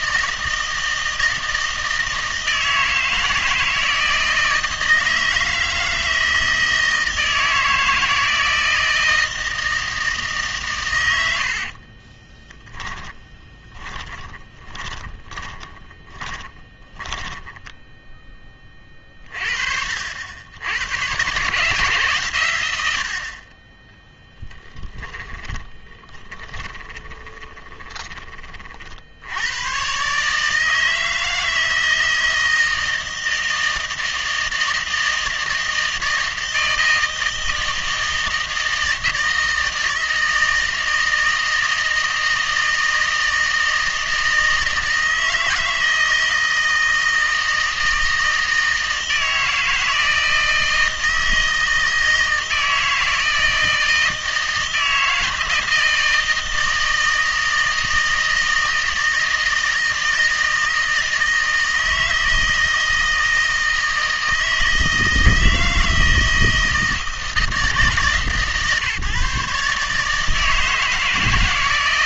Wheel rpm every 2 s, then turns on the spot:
160, 160, 160, 160, 160, 120, 20, 20, 20, 30, 110, 90, 10, 20, 50, 160, 160, 160, 160, 160, 160, 160, 160, 160, 160, 160, 160, 160, 160, 160, 160, 160, 160, 160, 150, 160.
12-18 24-28